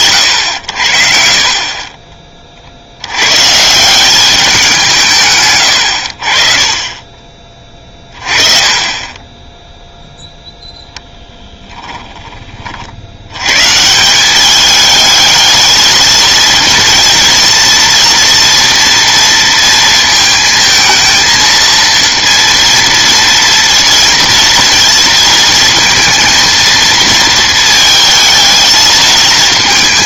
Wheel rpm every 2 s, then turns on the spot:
80, 60, 180, 30, 30, 0, 40, 210, 230, 230, 220, 230, 230, 230, 220.
none